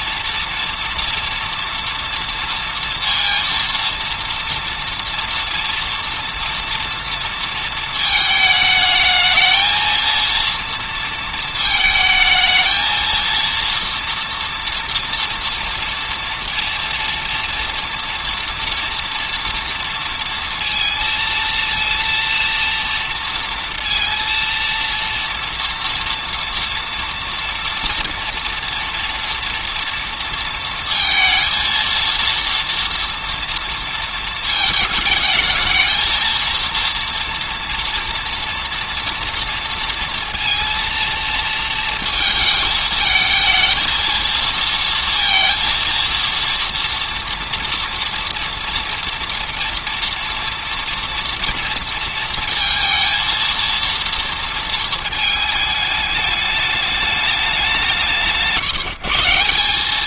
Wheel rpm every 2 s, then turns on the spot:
240, 230, 230, 230, 220, 230, 220, 230, 240, 230, 230, 230, 230, 230, 240, 230, 230, 220, 230, 230, 230, 220, 230, 240, 230, 230, 230, 230, 210, 150.
none